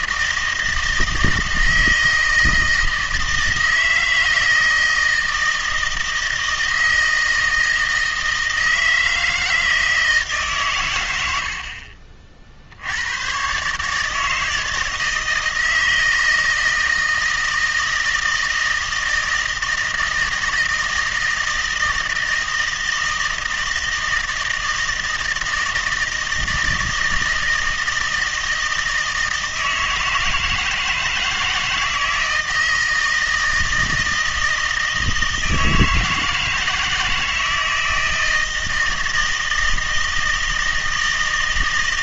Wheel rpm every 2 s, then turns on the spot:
160, 160, 160, 160, 160, 140, 60, 160, 160, 160, 160, 160, 160, 160, 160, 160, 160, 160, 160, 160, 160.
none